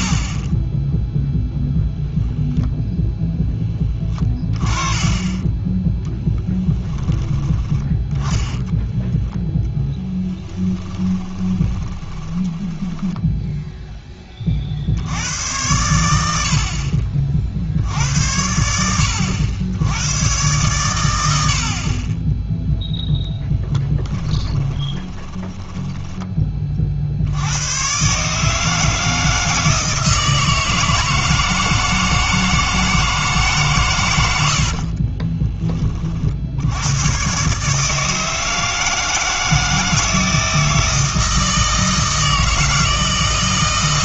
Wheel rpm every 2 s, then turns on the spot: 20, 0, 20, 10, 10, 10, 10, 50, 60, 80, 110, 0, 20, 40, 160, 160, 160, 60, 80, 160, 160, 160.
4-6 8-14 24-26 34-36